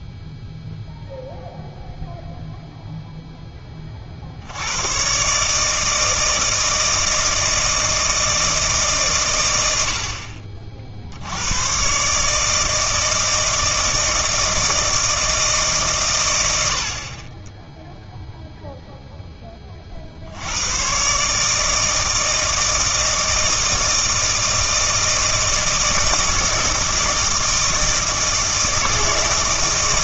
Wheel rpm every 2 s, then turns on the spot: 0, 0, 40, 160, 160, 60, 150, 160, 120, 0, 110, 160, 160, 160, 160.
none